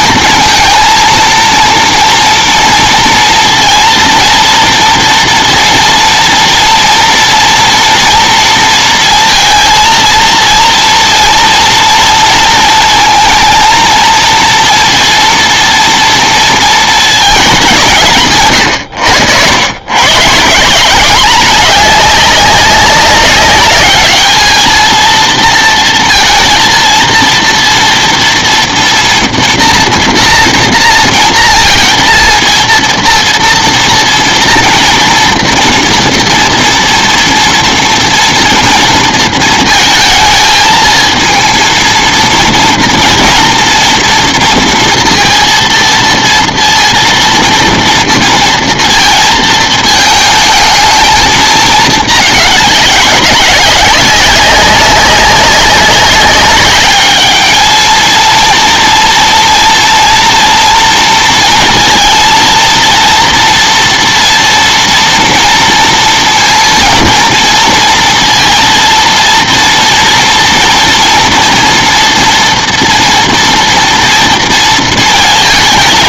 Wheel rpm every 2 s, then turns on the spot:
230, 230, 230, 230, 230, 230, 230, 230, 230, 120, 160, 200, 220, 230, 240, 230, 230, 230, 230, 240, 220, 230, 230, 230, 230, 220, 210, 200, 200, 240, 240, 230, 230, 230, 230, 240, 240, 230.
none